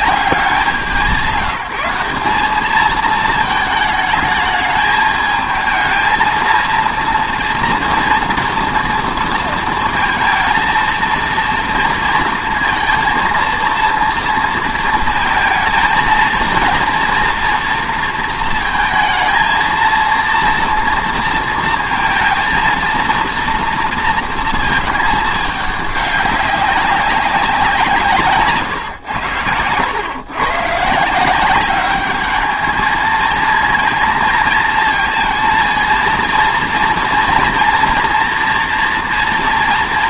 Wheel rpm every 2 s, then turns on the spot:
180, 220, 210, 230, 230, 230, 230, 230, 240, 220, 230, 230, 220, 190, 140, 140, 220, 230, 230, 230.
28-30